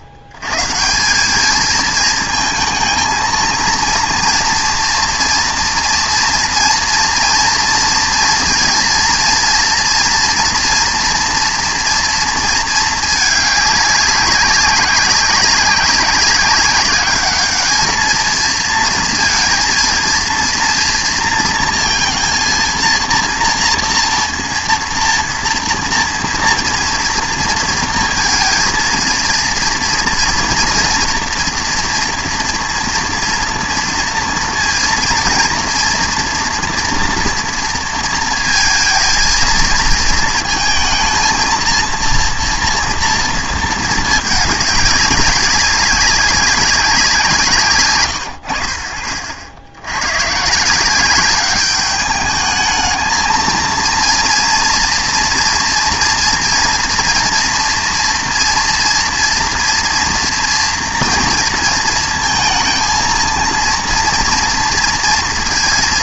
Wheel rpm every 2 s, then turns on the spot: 110, 230, 230, 230, 230, 230, 220, 200, 200, 230, 230, 230, 230, 230, 230, 230, 230, 230, 230, 220, 230, 230, 200, 200, 60, 160, 220, 230, 230, 230, 230, 230, 230.
none